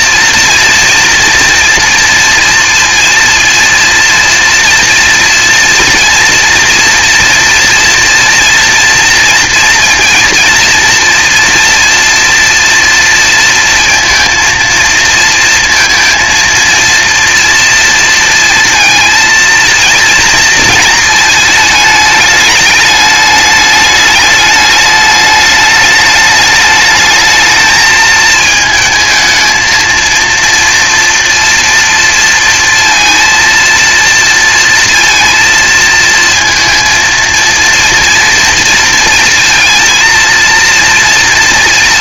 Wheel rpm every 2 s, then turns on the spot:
230, 230, 230, 230, 230, 230, 230, 230, 230, 230, 220, 210, 210, 210, 220, 230, 230, 230, 230, 230, 230.
none